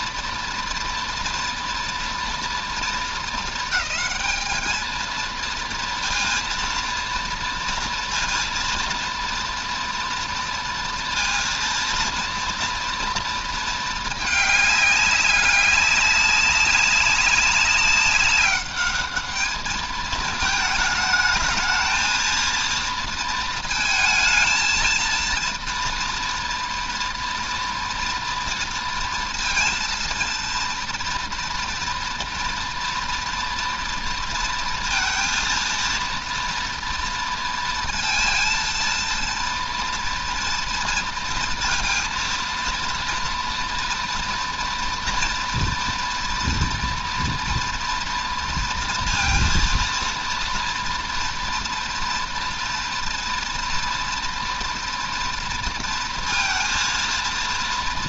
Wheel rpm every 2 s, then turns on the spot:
230, 230, 220, 230, 230, 230, 230, 210, 200, 200, 210, 230, 220, 230, 230, 230, 240, 230, 230, 230, 230, 230, 240, 230, 230, 230, 230, 230, 230.
none